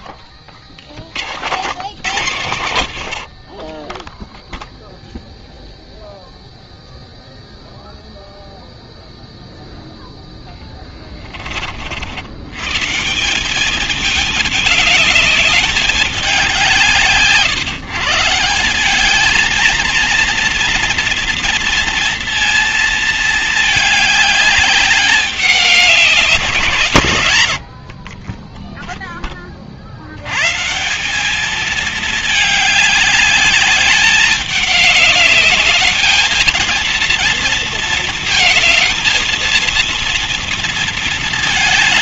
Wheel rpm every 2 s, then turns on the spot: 70, 80, 0, 0, 0, 20, 170, 210, 140, 200, 230, 220, 200, 140, 10, 190, 210, 210, 230, 230, 220.
2-4